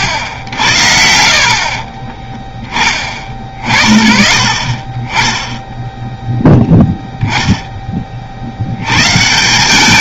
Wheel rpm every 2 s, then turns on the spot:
40, 20, 40, 0, 60.
none